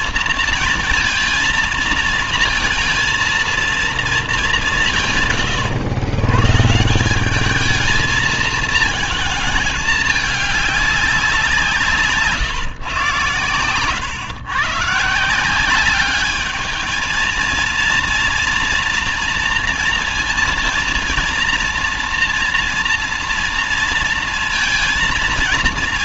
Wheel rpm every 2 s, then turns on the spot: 230, 230, 190, 150, 230, 210, 140, 140, 210, 230, 230, 230, 230.
none